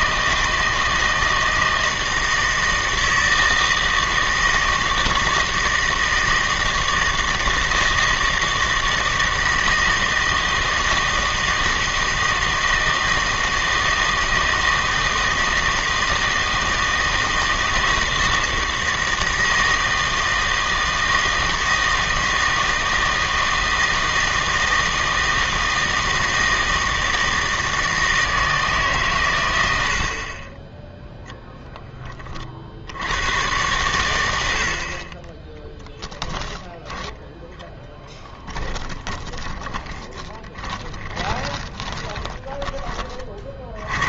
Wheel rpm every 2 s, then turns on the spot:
160, 160, 160, 160, 160, 160, 160, 160, 160, 160, 160, 160, 160, 160, 160, 20, 60, 60, 10, 10, 20, 20.
38-44